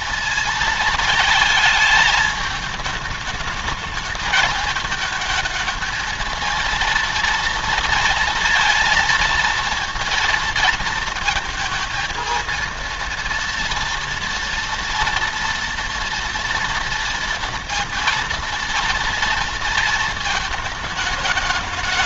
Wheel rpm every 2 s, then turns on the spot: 220, 210, 210, 230, 230, 230, 230, 230, 230, 230, 220.
none